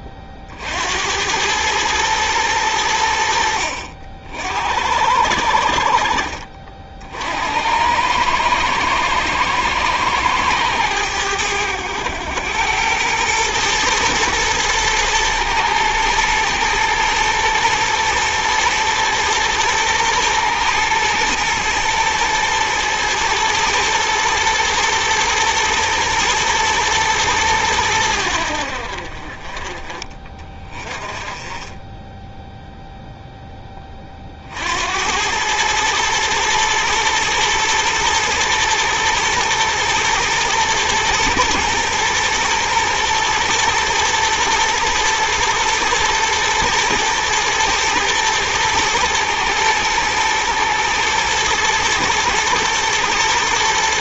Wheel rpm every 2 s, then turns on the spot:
70, 100, 80, 50, 110, 100, 100, 120, 120, 110, 120, 110, 110, 110, 60, 30, 0, 80, 110, 110, 120, 120, 110, 110, 110, 110, 120.
none